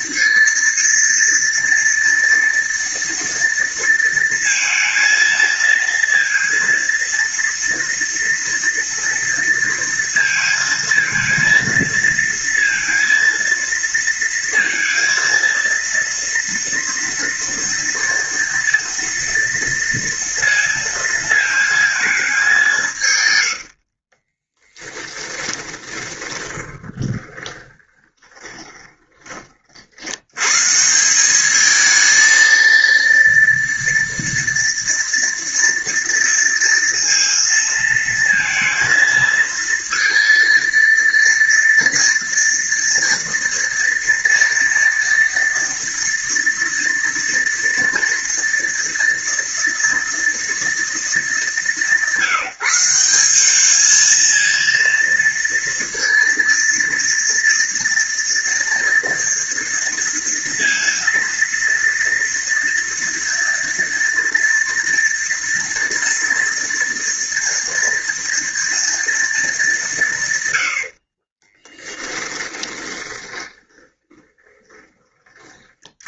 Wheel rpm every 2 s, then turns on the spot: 230, 230, 230, 230, 230, 230, 230, 230, 230, 230, 230, 170, 10, 20, 20, 150, 230, 230, 230, 220, 230, 230, 230, 230, 230, 210, 180, 230, 230, 230, 230, 240, 230, 230, 230, 80, 20, 20.
24-30 70-74